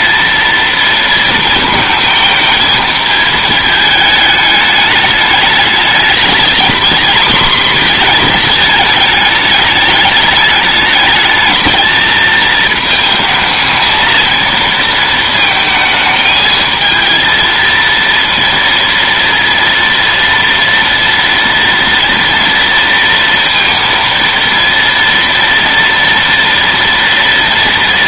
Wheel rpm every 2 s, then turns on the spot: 230, 220, 220, 220, 220, 210, 220, 230, 220, 230, 230, 230, 230, 230.
none